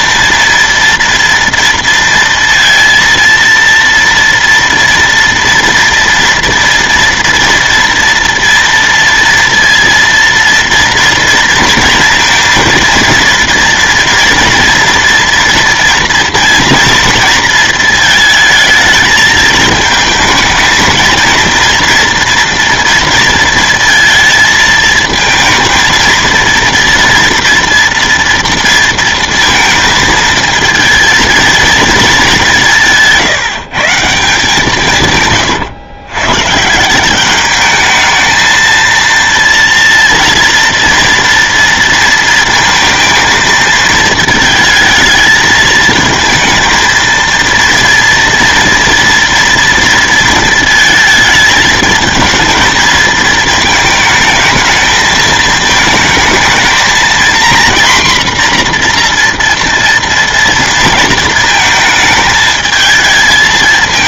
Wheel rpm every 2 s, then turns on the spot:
230, 230, 230, 230, 230, 230, 230, 230, 230, 220, 220, 230, 220, 230, 230, 230, 180, 160, 160, 230, 230, 230, 220, 230, 230, 220, 230, 220, 230, 240, 230, 220.
none